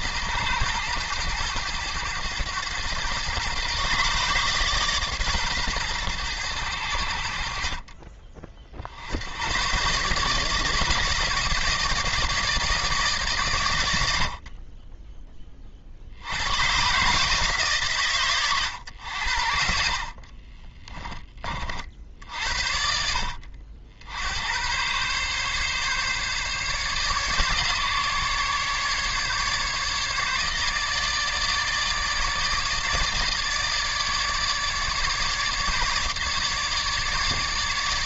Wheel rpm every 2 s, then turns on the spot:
110, 110, 140, 80, 70, 150, 150, 20, 130, 100, 20, 70, 120, 140, 150, 150, 150, 150, 150.
20-22